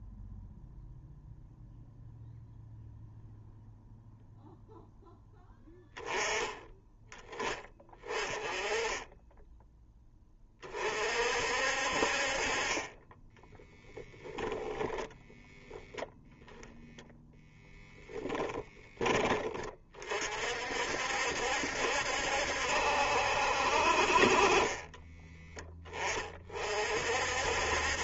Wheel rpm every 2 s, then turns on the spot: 0, 0, 0, 10, 10, 40, 40, 10, 10, 20, 60, 70, 20, 50.
14-16 18-20 24-26